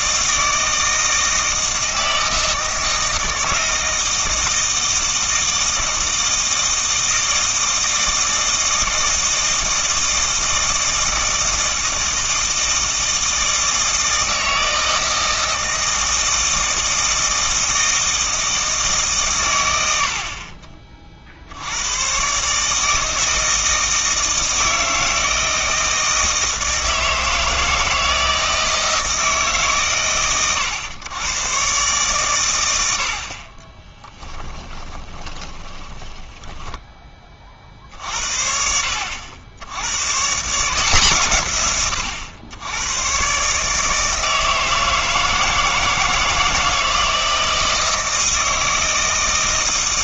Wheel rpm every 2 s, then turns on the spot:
160, 160, 160, 160, 160, 160, 160, 160, 160, 160, 30, 150, 160, 160, 160, 110, 80, 20, 10, 60, 160, 100, 160, 160, 160.
34-36